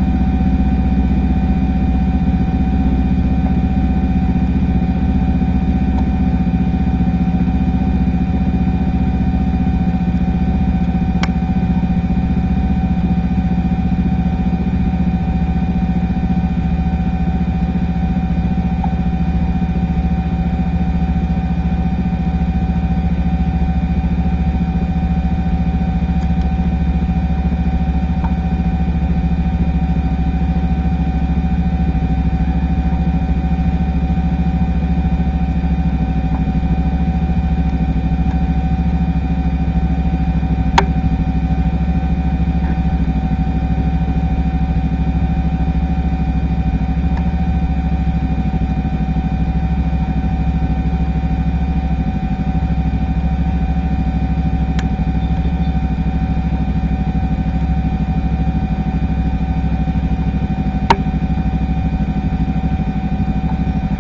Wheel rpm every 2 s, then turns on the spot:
0, 0, 0, 0, 0, 0, 0, 0, 0, 0, 0, 0, 0, 0, 0, 0, 0, 0, 0, 0, 0, 0, 0, 0, 0, 0, 0, 0, 0, 0, 0, 0.
none